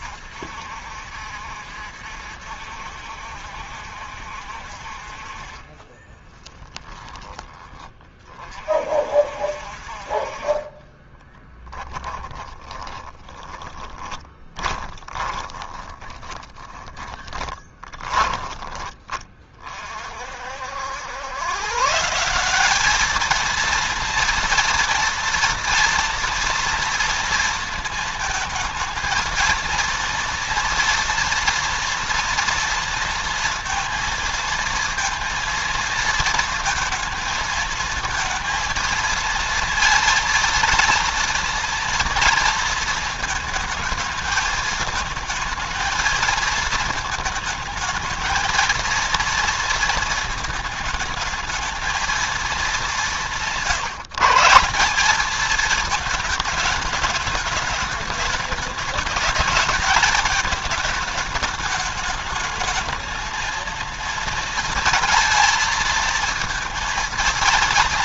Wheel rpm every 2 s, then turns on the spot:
60, 70, 50, 10, 50, 20, 20, 20, 20, 20, 80, 200, 230, 230, 220, 230, 230, 230, 220, 230, 230, 230, 220, 220, 230, 220, 200, 180, 220, 210, 210, 220, 230, 230.
6-8 10-18